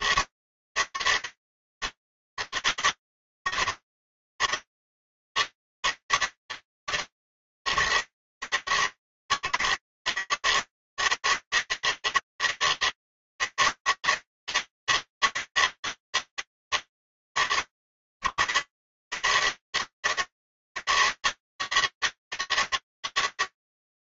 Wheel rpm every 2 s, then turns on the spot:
140, 130, 150, 140, 120, 120, 150, 160, 150, 110, 150, 160.
none